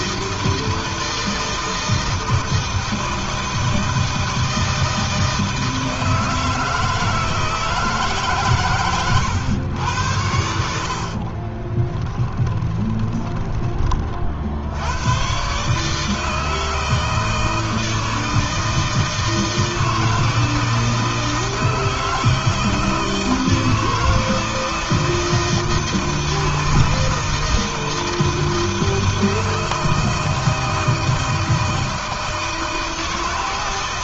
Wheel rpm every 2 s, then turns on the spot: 160, 160, 160, 160, 140, 60, 20, 80, 160, 160, 160, 160, 170, 160, 160, 160, 160.
12-14